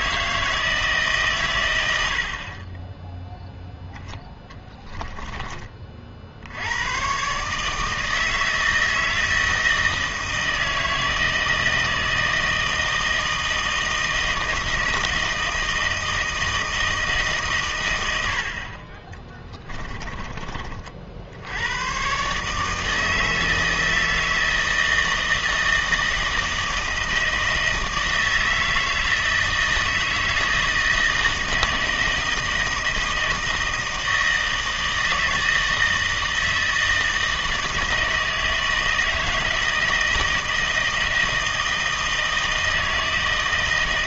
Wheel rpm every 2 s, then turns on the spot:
160, 20, 10, 90, 160, 160, 160, 160, 160, 50, 40, 150, 160, 160, 160, 160, 160, 160, 160, 160, 160, 160.
4-6